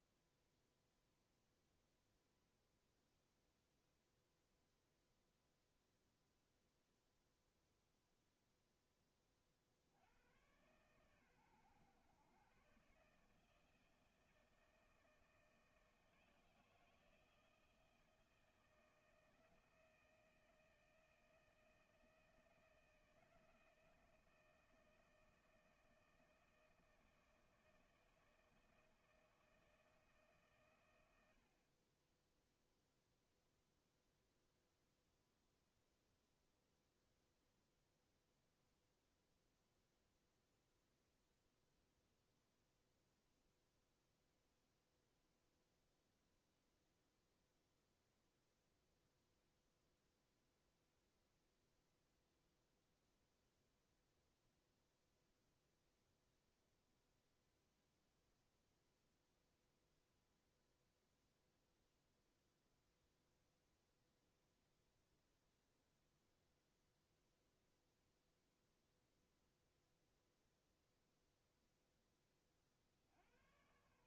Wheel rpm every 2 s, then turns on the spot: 0, 0, 0, 0, 0, 100, 120, 160, 160, 160, 160, 160, 160, 160, 160, 140, 0, 0, 0, 0, 0, 0, 0, 0, 0, 0, 0, 0, 0, 0, 0, 0, 0, 0, 0, 0, 30.
none